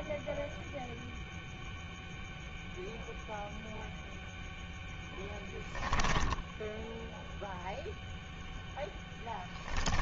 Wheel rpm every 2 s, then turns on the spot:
0, 0, 0, 10, 0.
6-8